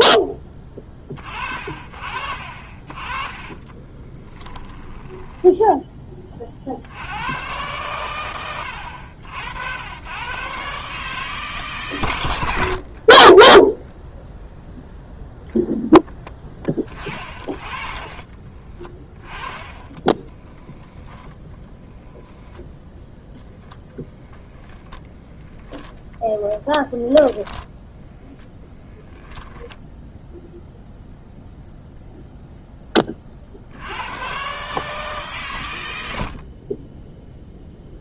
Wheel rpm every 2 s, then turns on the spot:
20, 40, 20, 60, 70, 140, 50, 0, 30, 20, 10, 0, 10, 10, 10, 0, 10, 140, 20.
4-6 12-14 16-20 28-30